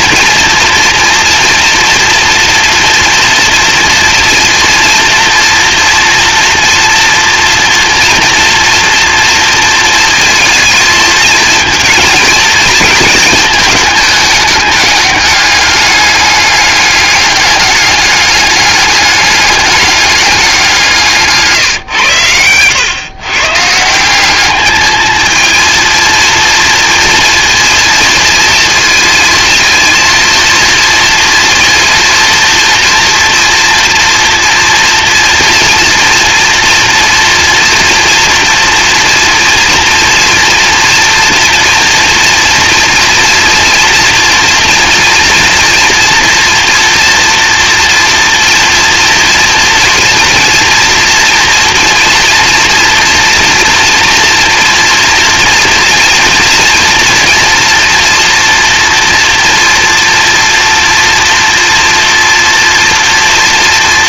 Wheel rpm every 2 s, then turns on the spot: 230, 230, 240, 230, 240, 220, 220, 210, 200, 200, 170, 110, 220, 230, 230, 230, 240, 240, 230, 230, 230, 240, 230, 230, 230, 230, 230, 230, 230, 230, 230, 230.
none